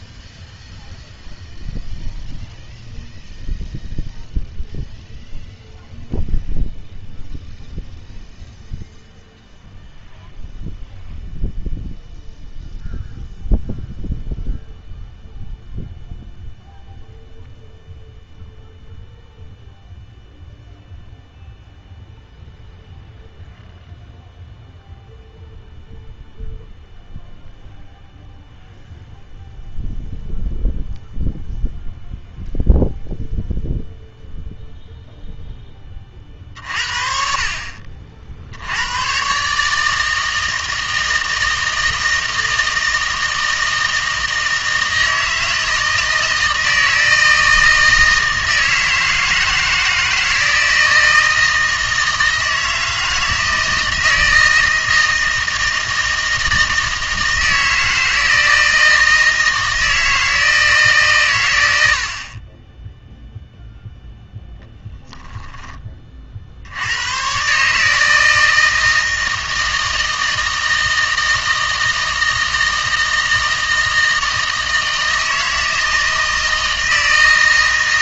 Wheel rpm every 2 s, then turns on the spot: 0, 0, 0, 0, 0, 0, 0, 0, 0, 0, 0, 0, 0, 0, 0, 0, 0, 0, 50, 80, 160, 160, 160, 160, 160, 160, 160, 160, 160, 160, 160, 20, 10, 70, 160, 160, 160, 160, 160.
64-66